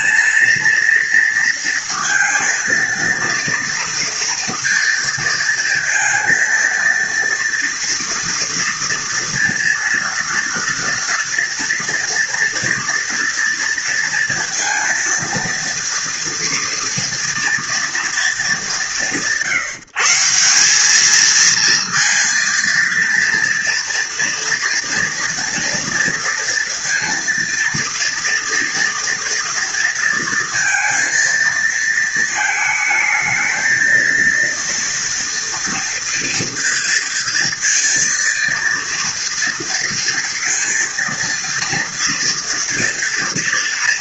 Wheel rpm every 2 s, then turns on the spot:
230, 230, 230, 230, 230, 230, 230, 230, 230, 200, 180, 230, 230, 230, 230, 230, 220, 230, 230, 230, 230, 230.
none